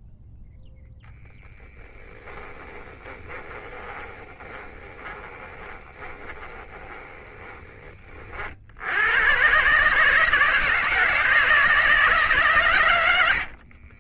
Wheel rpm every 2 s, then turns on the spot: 0, 20, 20, 20, 80, 160, 120.
2-8